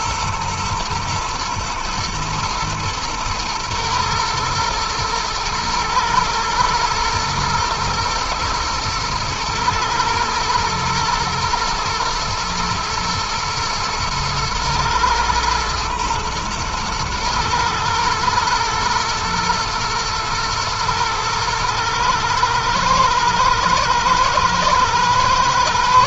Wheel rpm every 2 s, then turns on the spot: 120, 110, 110, 110, 110, 120, 110, 120, 120, 110, 110, 110, 120.
none